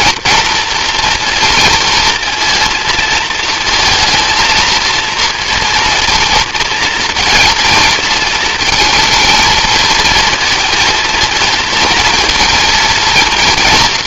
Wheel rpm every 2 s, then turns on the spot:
230, 230, 230, 230, 220, 220, 230.
none